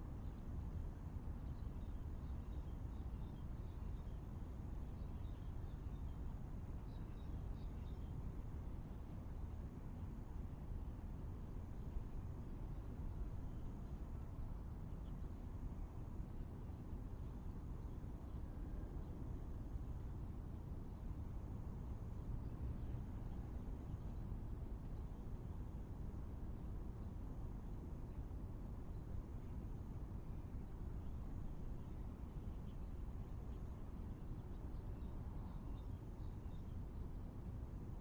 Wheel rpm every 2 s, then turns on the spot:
0, 0, 0, 0, 0, 0, 0, 0, 0, 0, 0, 0, 0, 0, 0, 0, 0, 0, 0.
none